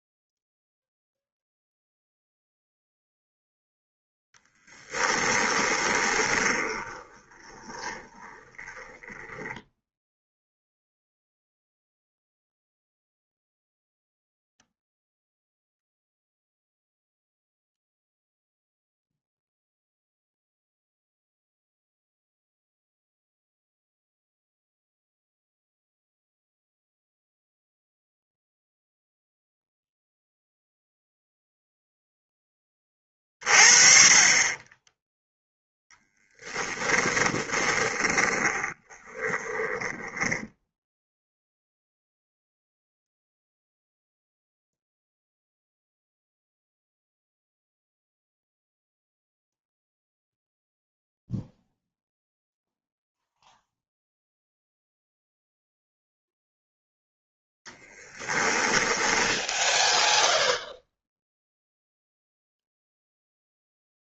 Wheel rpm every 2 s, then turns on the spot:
0, 0, 10, 20, 10, 0, 0, 0, 0, 0, 0, 0, 0, 0, 0, 0, 30, 20, 20, 20, 0, 0, 0, 0, 0, 0, 0, 0, 0, 10, 0, 0.
4-10 36-40 58-60